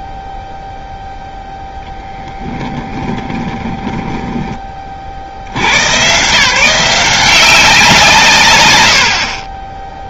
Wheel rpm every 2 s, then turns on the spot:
0, 10, 30, 170, 90.
2-4